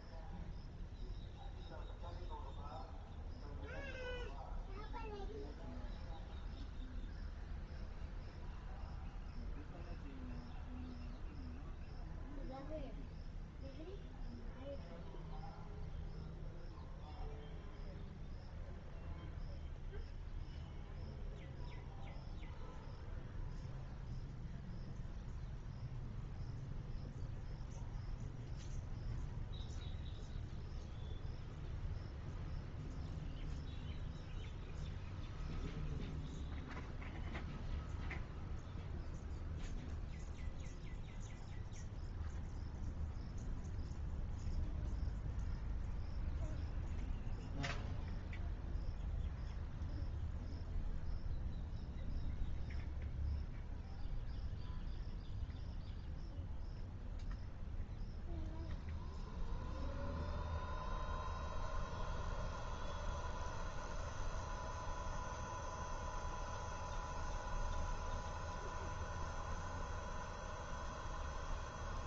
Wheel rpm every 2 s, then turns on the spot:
0, 0, 0, 0, 0, 0, 0, 0, 0, 0, 0, 0, 0, 0, 0, 0, 0, 0, 0, 0, 0, 0, 0, 0, 0, 0, 0, 0, 0, 0, 0, 0, 0, 0, 0, 0.
none